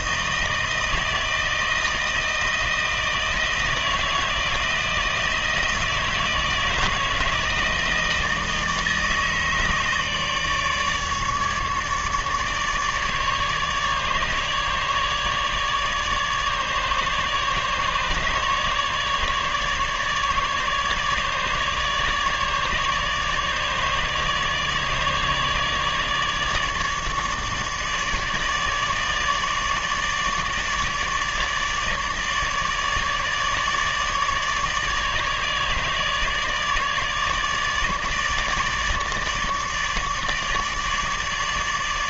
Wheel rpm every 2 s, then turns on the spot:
160, 160, 160, 160, 160, 150, 150, 150, 150, 150, 150, 150, 150, 150, 150, 150, 150, 150, 150, 150, 150.
none